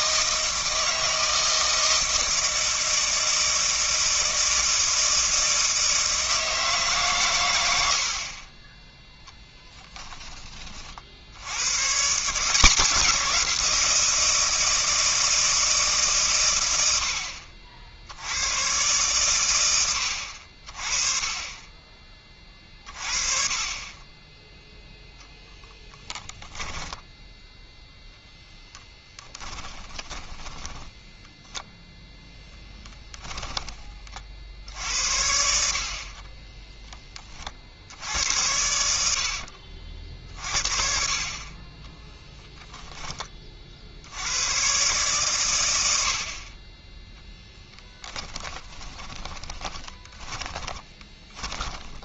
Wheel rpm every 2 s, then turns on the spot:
160, 160, 160, 150, 20, 30, 170, 160, 100, 120, 40, 40, 0, 20, 10, 10, 10, 70, 30, 80, 50, 10, 120, 20, 10, 20.
26-34 48-52